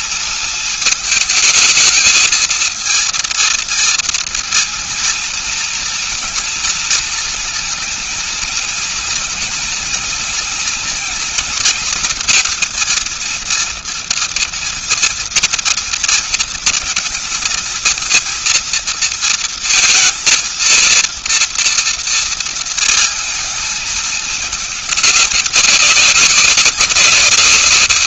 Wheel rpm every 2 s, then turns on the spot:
220, 230, 230, 230, 230, 230, 230, 230, 230, 230, 230, 220, 200, 170.
none